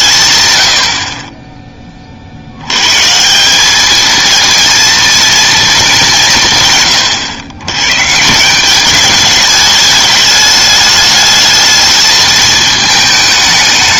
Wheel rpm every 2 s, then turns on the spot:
110, 90, 230, 140, 190, 210, 220.
none